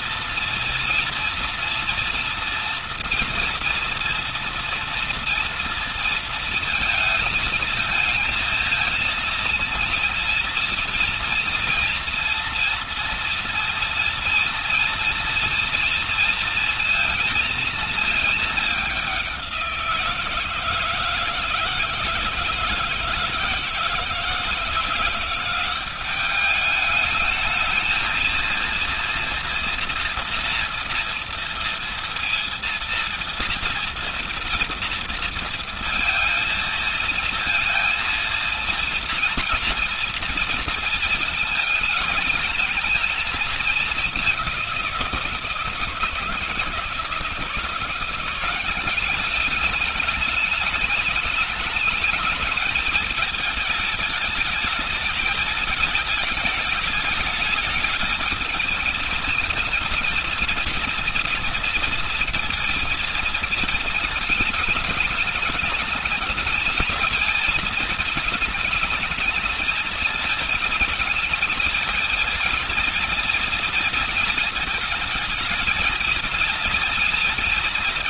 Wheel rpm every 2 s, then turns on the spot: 230, 230, 230, 230, 220, 230, 230, 230, 230, 210, 170, 170, 160, 200, 230, 230, 230, 230, 230, 230, 230, 220, 190, 160, 190, 210, 220, 220, 220, 210, 230, 220, 210, 210, 220, 220, 230, 220, 230.
none